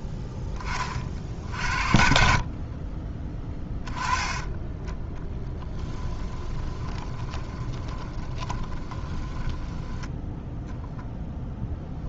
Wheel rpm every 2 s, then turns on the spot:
30, 30, 10, 10, 20, 0.
2-4 6-10